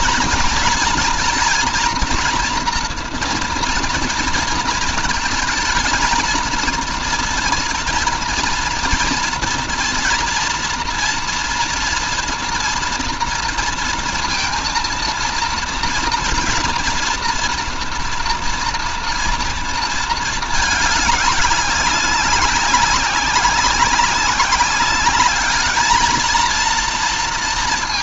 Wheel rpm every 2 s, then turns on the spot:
230, 240, 230, 230, 230, 230, 230, 230, 230, 240, 220, 190, 200, 220.
none